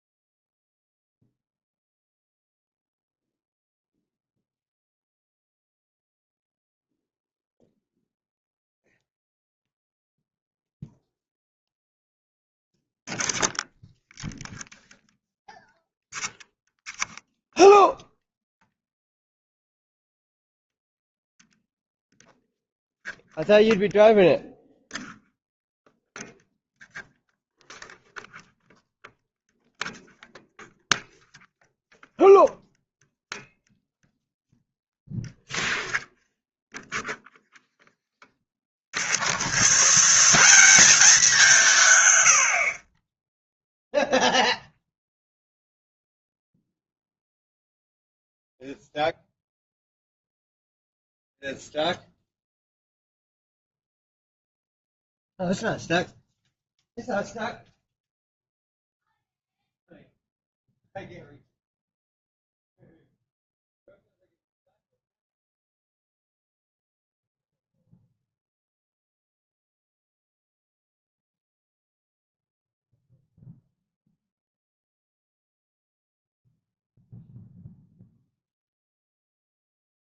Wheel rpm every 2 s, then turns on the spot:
0, 0, 0, 0, 0, 0, 0, 0, 0, 0, 0, 0, 0, 0, 0, 0, 0, 0, 0, 30, 180, 60, 0, 0, 0, 0, 0, 0, 0, 0, 0, 0, 0, 0, 0, 0, 0, 0, 0, 0.
none